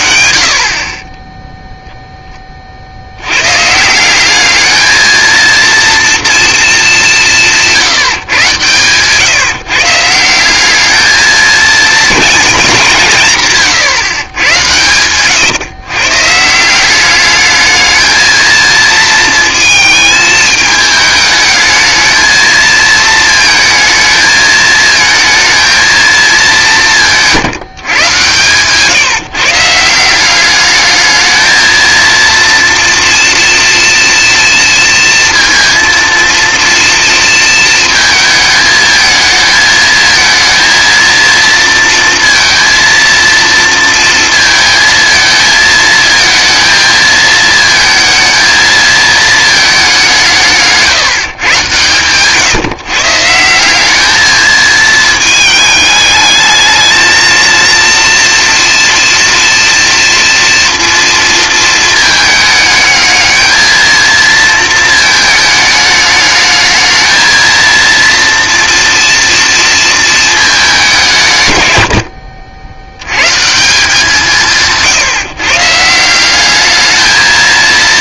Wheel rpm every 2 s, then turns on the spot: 50, 40, 210, 230, 130, 210, 190, 110, 170, 220, 220, 220, 220, 190, 150, 210, 230, 230, 230, 220, 230, 230, 230, 220, 220, 160, 150, 220, 220, 230, 230, 210, 230, 220, 230, 210, 80, 160, 210.
none